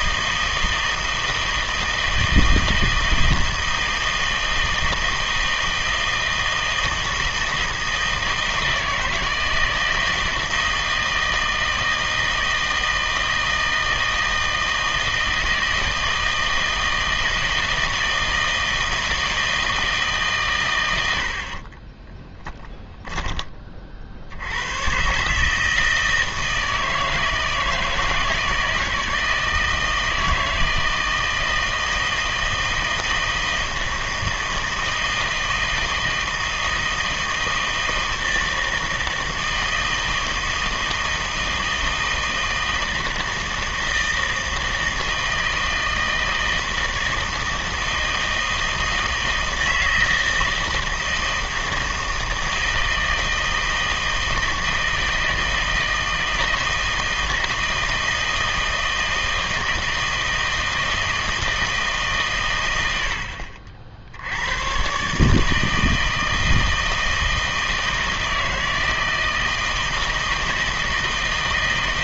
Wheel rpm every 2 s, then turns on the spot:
160, 160, 160, 160, 160, 160, 160, 160, 160, 160, 100, 10, 90, 160, 160, 160, 160, 160, 160, 160, 160, 160, 160, 160, 160, 160, 160, 160, 160, 160, 160, 100, 110, 160, 160, 160.
22-24